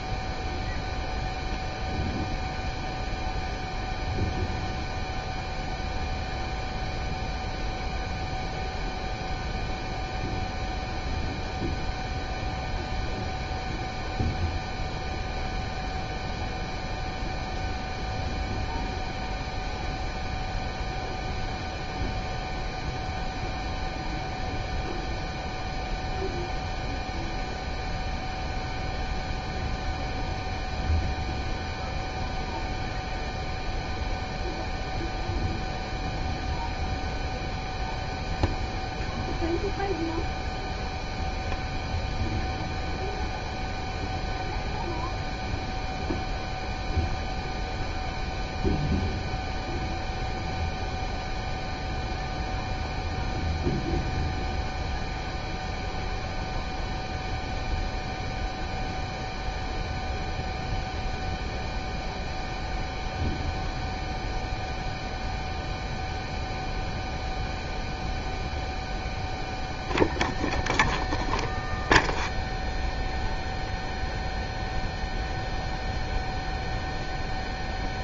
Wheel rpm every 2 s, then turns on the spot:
0, 0, 0, 0, 0, 0, 0, 0, 0, 0, 0, 0, 0, 0, 0, 0, 0, 0, 0, 0, 0, 0, 0, 0, 0, 0, 0, 0, 0, 0, 0, 0, 0, 0, 0, 0, 0, 0, 0.
none